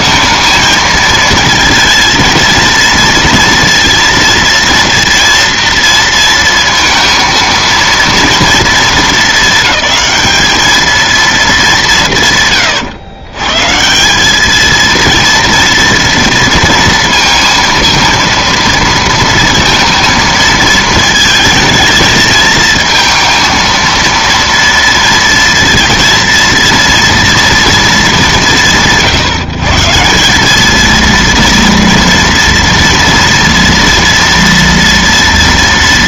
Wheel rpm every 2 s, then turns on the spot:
230, 230, 230, 230, 230, 220, 130, 220, 230, 230, 220, 220, 230, 230, 180, 230, 230, 230.
none